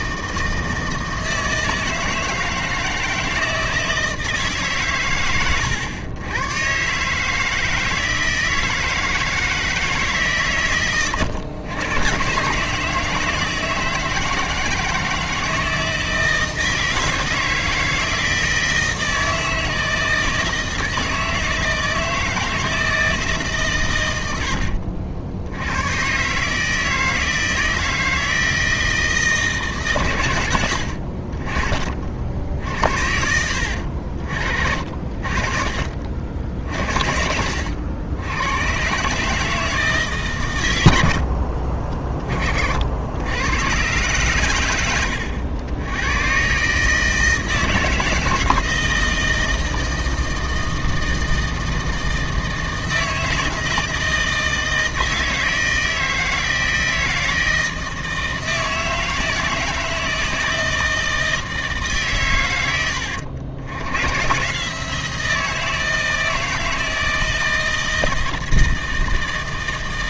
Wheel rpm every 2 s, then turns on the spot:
160, 160, 140, 120, 160, 130, 140, 160, 160, 160, 160, 160, 70, 160, 160, 80, 60, 50, 60, 120, 100, 50, 100, 140, 160, 160, 160, 160, 160, 160, 160, 100, 150, 160, 160.
24-26